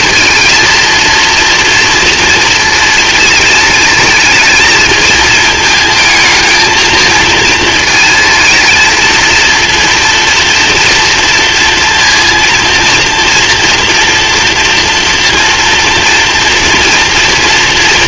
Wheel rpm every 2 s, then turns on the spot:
230, 230, 220, 230, 230, 230, 230, 230, 230.
none